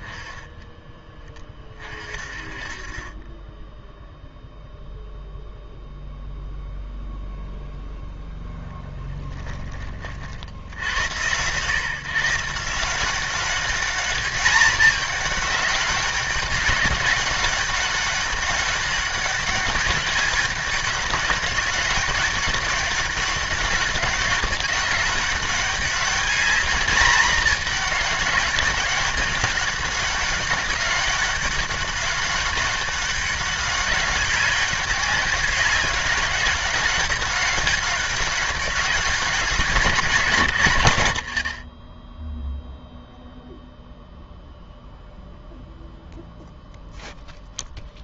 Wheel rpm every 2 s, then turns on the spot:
20, 40, 0, 0, 0, 60, 160, 210, 200, 200, 210, 190, 190, 220, 190, 200, 200, 200, 200, 200, 170, 0, 0, 0.
none